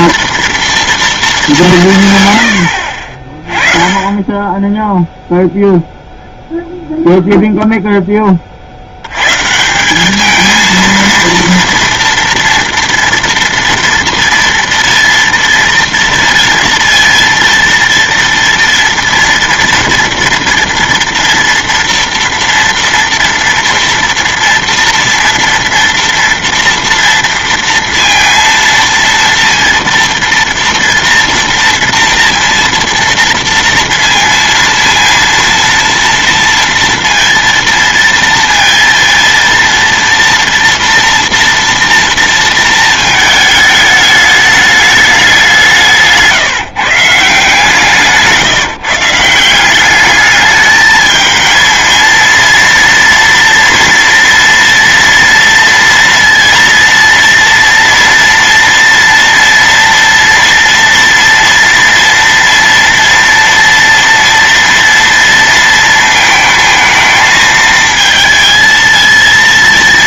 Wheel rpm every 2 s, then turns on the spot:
230, 80, 10, 0, 50, 220, 230, 230, 230, 230, 230, 230, 230, 230, 230, 230, 230, 230, 230, 230, 230, 230, 210, 150, 150, 210, 230, 230, 230, 240, 230, 230, 230, 220, 230.
none